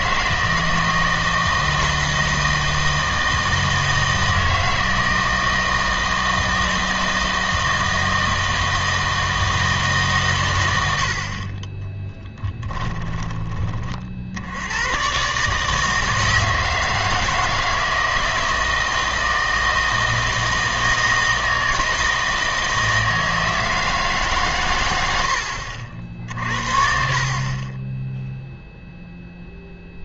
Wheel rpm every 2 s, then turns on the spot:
160, 160, 160, 160, 160, 100, 10, 80, 160, 160, 160, 160, 130, 50, 0.
12-14 26-28